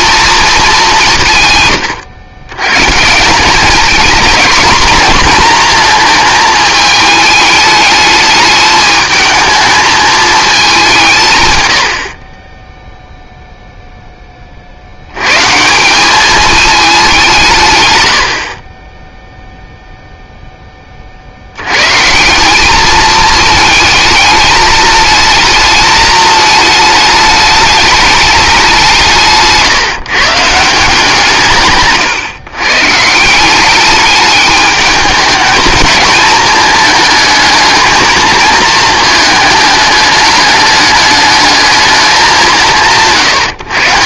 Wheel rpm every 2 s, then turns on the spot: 200, 130, 230, 220, 220, 200, 10, 50, 210, 20, 10, 210, 220, 220, 180, 170, 130, 210, 220, 220, 210, 150.
18-20